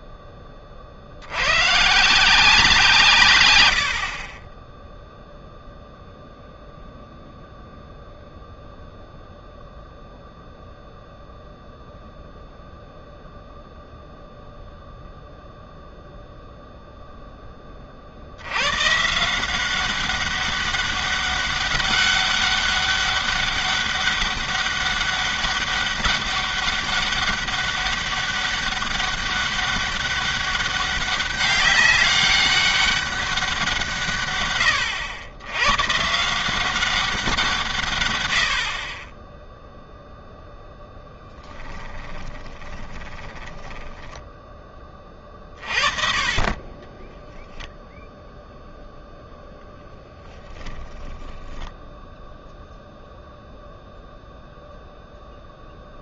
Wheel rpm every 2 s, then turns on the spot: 40, 170, 10, 0, 0, 0, 0, 0, 0, 110, 200, 200, 200, 200, 200, 200, 200, 110, 180, 40, 0, 20, 20, 20, 0, 10, 0, 0.
42-44